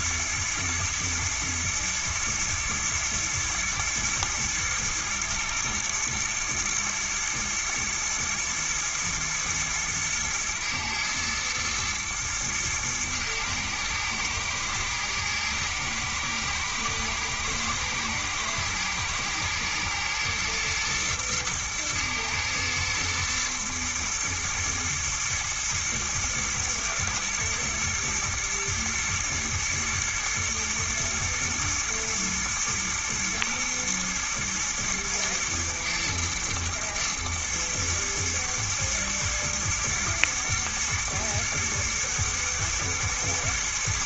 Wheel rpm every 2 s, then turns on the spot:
110, 110, 110, 110, 120, 120, 110, 110, 110, 120, 120, 110, 120, 120, 110, 120, 110, 110, 120, 120, 120, 110.
none